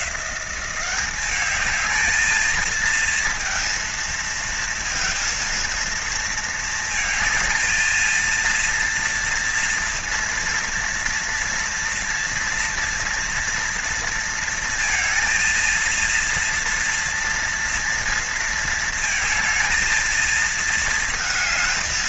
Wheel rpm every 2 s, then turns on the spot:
190, 220, 230, 220, 230, 230, 230, 230, 230, 230, 220.
none